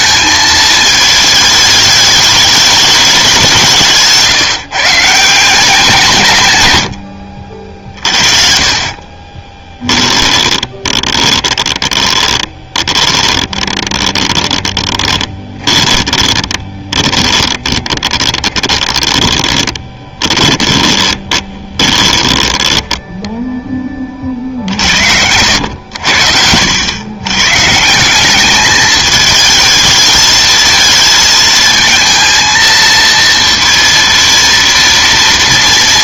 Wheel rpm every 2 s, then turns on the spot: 220, 210, 140, 110, 40, 20, 20, 20, 30, 20, 20, 10, 60, 90, 210, 220, 230, 230.
8-24